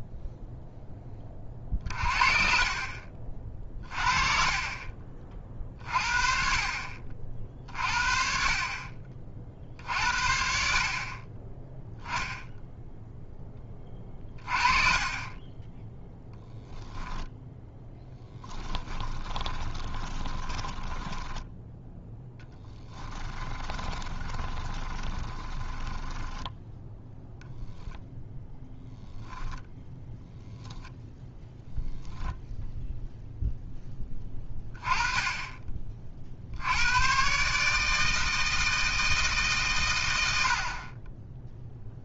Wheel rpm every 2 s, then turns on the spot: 10, 50, 30, 50, 40, 40, 0, 20, 0, 20, 10, 10, 20, 0, 0, 0, 0, 10, 90, 160, 40.
18-26